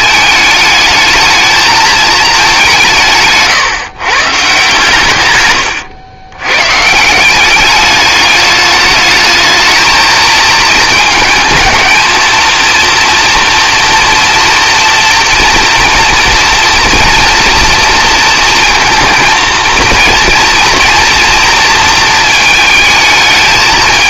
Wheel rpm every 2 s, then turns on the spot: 210, 180, 140, 140, 210, 220, 240, 230, 230, 230, 230, 220.
none